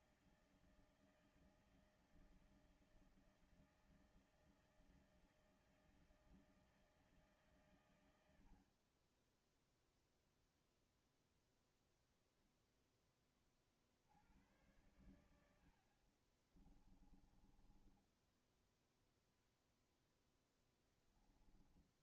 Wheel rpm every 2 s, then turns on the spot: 160, 160, 160, 160, 70, 0, 0, 90, 40, 10, 10.
8-10 16-22